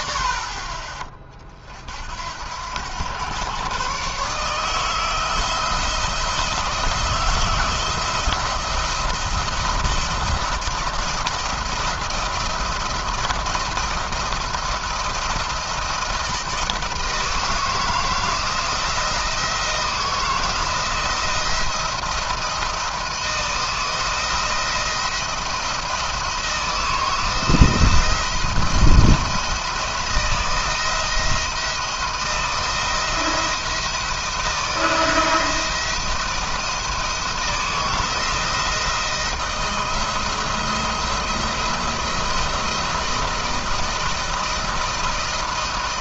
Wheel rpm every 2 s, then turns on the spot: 50, 100, 160, 170, 170, 170, 170, 170, 160, 170, 160, 160, 170, 160, 160, 170, 170, 170, 160, 160, 170, 170, 170.
none